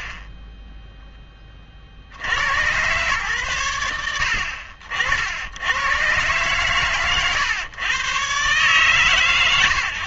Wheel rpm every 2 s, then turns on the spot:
20, 110, 70, 120, 130.
0-2